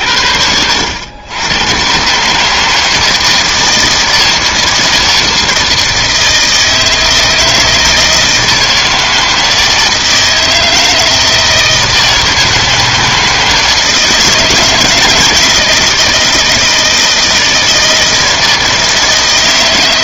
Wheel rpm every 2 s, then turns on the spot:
80, 160, 160, 160, 160, 160, 160, 160, 160, 160.
none